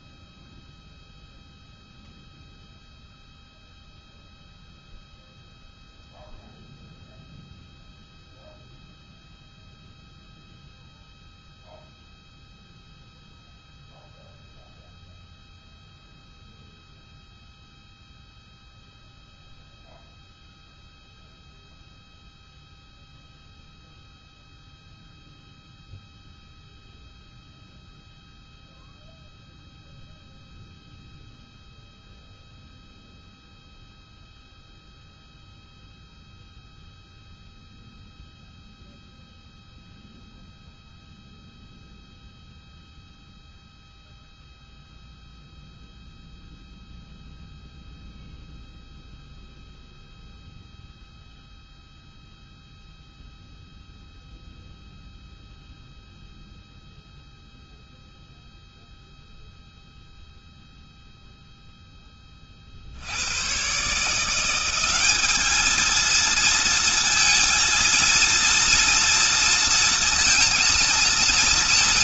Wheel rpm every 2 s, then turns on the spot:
0, 0, 0, 0, 0, 0, 0, 0, 0, 0, 0, 0, 0, 0, 0, 0, 0, 0, 0, 0, 0, 0, 0, 0, 0, 0, 0, 0, 0, 0, 0, 40, 180, 230, 230, 230.
none